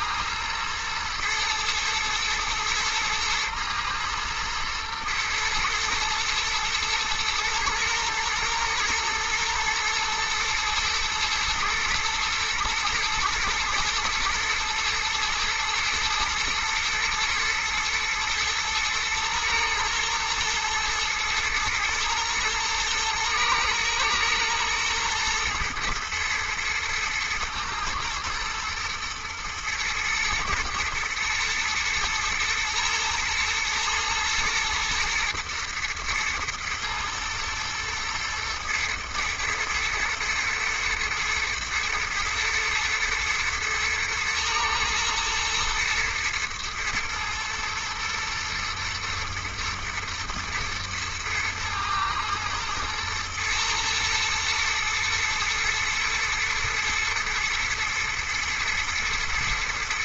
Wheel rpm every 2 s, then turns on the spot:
110, 110, 120, 110, 110, 120, 110, 120, 120, 120, 110, 110, 120, 110, 120, 110, 110, 110, 110, 120, 110, 120, 110, 120, 110, 110, 110, 110, 120, 110.
none